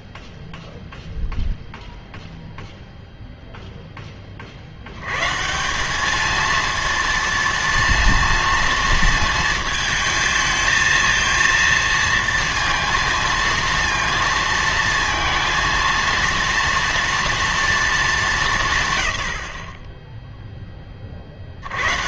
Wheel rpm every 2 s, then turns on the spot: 0, 0, 60, 230, 230, 230, 230, 230, 230, 150, 10.
none